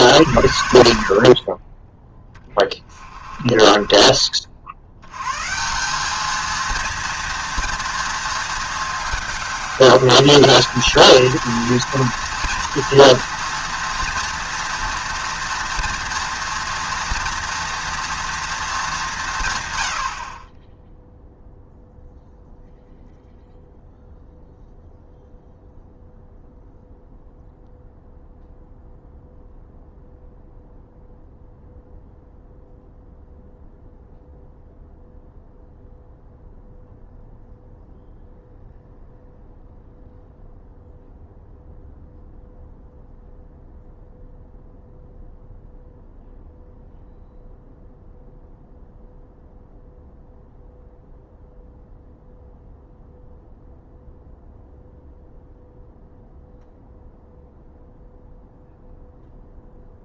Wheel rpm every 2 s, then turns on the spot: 60, 30, 90, 230, 220, 220, 230, 230, 230, 200, 10, 0, 0, 0, 0, 0, 0, 0, 0, 0, 0, 0, 0, 0, 0, 0, 0, 0, 0, 0.
none